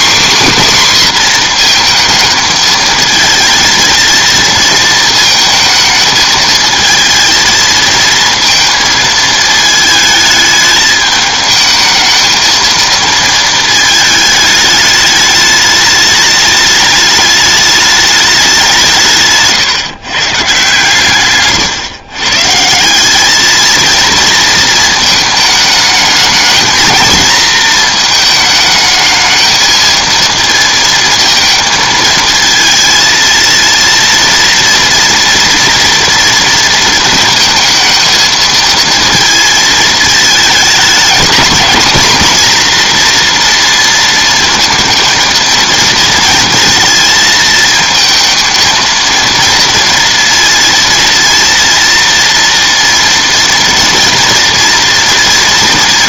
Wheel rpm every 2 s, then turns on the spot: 270, 220, 230, 220, 230, 220, 220, 210, 210, 190, 130, 160, 220, 230, 220, 230, 230, 230, 230, 220, 220, 240, 230, 220, 220, 230, 230, 230.
none